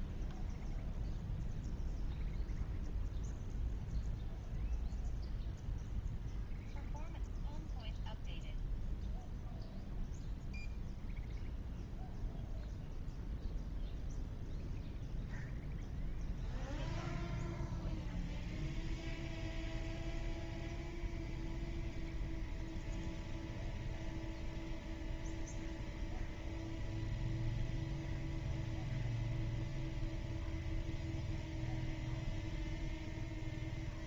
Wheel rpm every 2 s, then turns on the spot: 0, 0, 0, 0, 0, 0, 0, 0, 0, 0, 0, 0, 0, 0, 0, 0, 0.
none